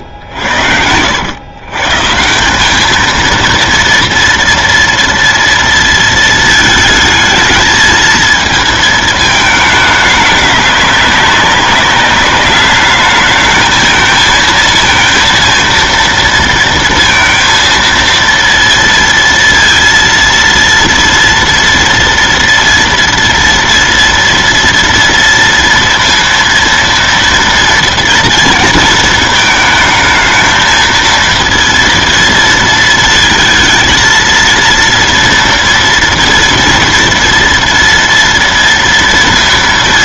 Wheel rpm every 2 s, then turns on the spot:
110, 160, 230, 220, 220, 210, 200, 220, 230, 230, 230, 230, 230, 230, 230, 220, 230, 230, 240, 230.
none